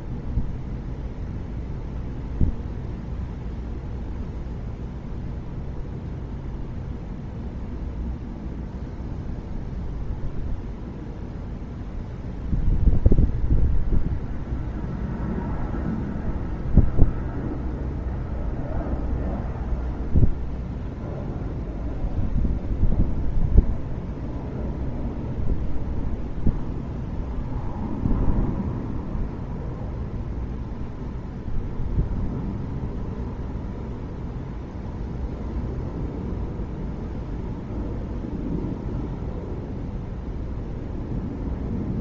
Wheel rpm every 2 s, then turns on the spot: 0, 0, 0, 0, 0, 0, 0, 0, 0, 0, 0, 0, 0, 0, 0, 0, 0, 0, 0, 0, 0.
none